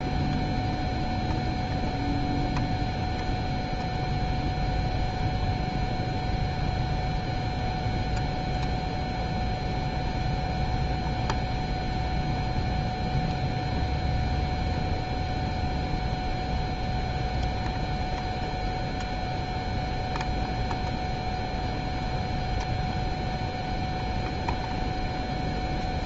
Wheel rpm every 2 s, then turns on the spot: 0, 0, 0, 0, 0, 0, 0, 0, 0, 0, 0, 0, 0.
none